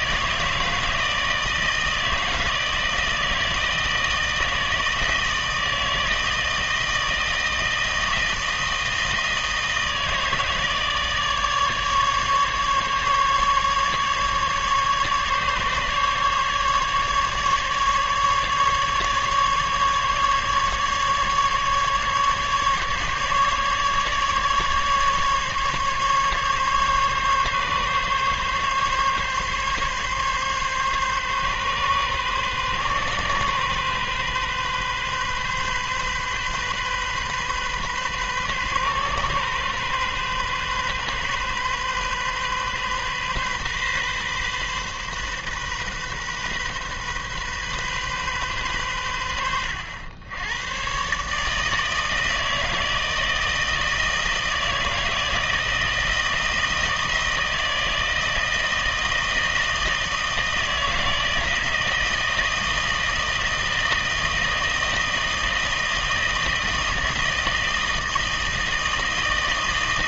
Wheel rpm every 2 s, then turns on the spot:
160, 160, 160, 160, 160, 150, 150, 140, 150, 150, 150, 150, 150, 140, 140, 140, 130, 130, 130, 130, 130, 130, 130, 130, 120, 110, 160, 160, 160, 160, 160, 160, 160, 160, 160.
none